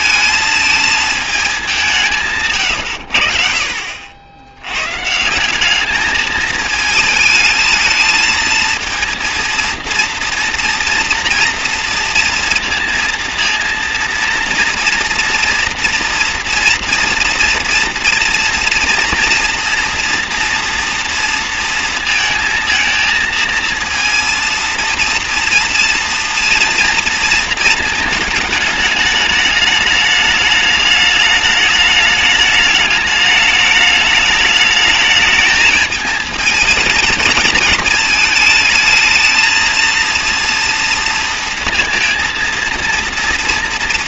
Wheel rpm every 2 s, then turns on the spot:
220, 140, 90, 220, 220, 230, 230, 230, 240, 240, 230, 230, 230, 230, 220, 210, 210, 210, 220, 220, 230, 230.
none